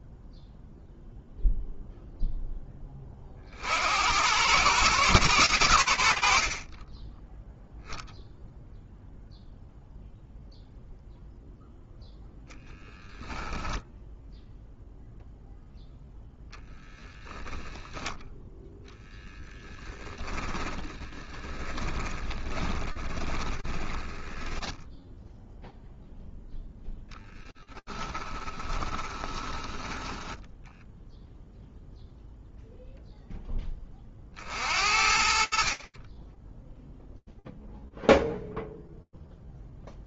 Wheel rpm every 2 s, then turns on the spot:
0, 0, 40, 90, 0, 0, 0, 0, 10, 10, 10, 20, 0, 0, 20, 0, 0, 50, 0, 0.
18-24 28-30